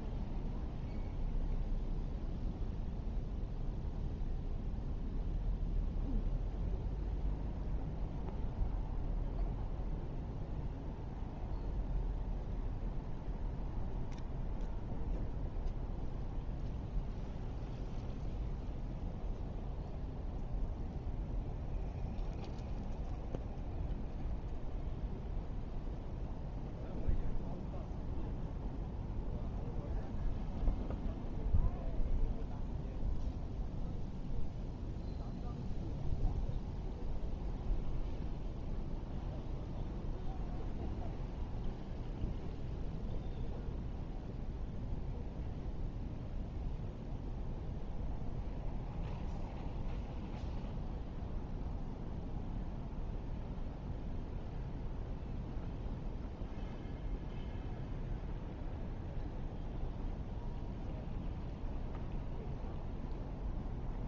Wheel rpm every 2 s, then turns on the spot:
0, 0, 0, 0, 0, 0, 0, 0, 0, 0, 0, 0, 0, 0, 0, 0, 0, 0, 0, 0, 0, 0, 0, 0, 0, 0, 0, 0, 0, 0, 0, 0.
none